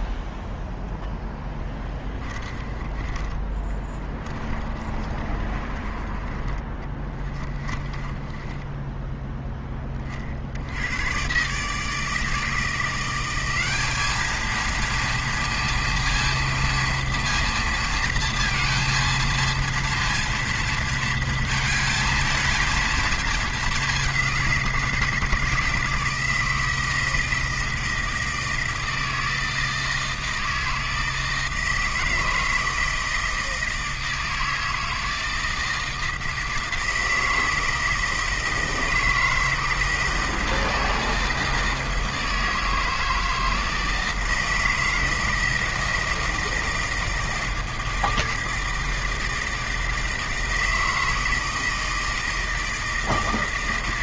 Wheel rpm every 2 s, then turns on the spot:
0, 20, 30, 20, 10, 80, 170, 230, 230, 230, 230, 220, 170, 160, 160, 160, 160, 160, 160, 160, 160, 160, 160, 160, 160, 160, 160.
2-10